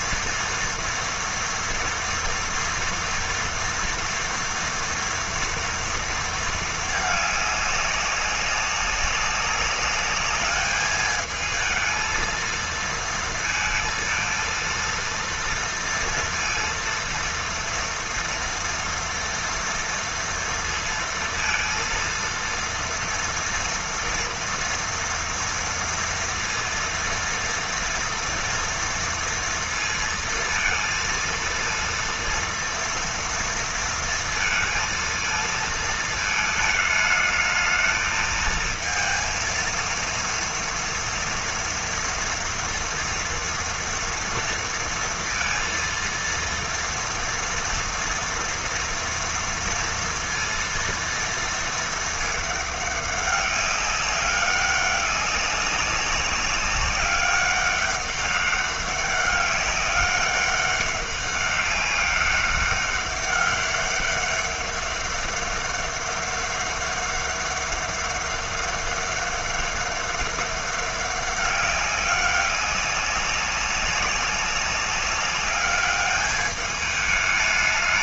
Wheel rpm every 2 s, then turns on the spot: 240, 230, 230, 220, 200, 210, 230, 230, 230, 230, 230, 230, 230, 230, 230, 230, 230, 230, 220, 230, 230, 230, 230, 230, 230, 230, 210, 200, 190, 200, 200, 200, 200, 200, 200, 200, 200, 200, 210.
none